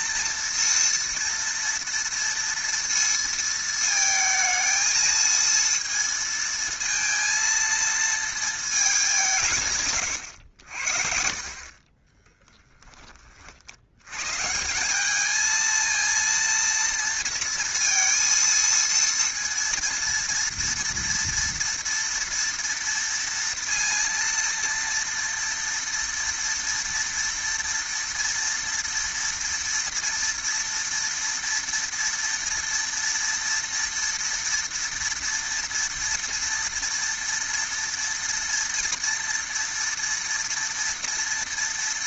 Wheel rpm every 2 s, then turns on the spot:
240, 230, 230, 230, 230, 90, 10, 140, 230, 230, 230, 230, 230, 230, 230, 230, 230, 230, 230, 230, 230.
none